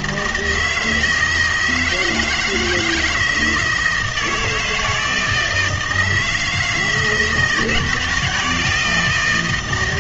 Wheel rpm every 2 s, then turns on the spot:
160, 160, 160, 160, 170.
none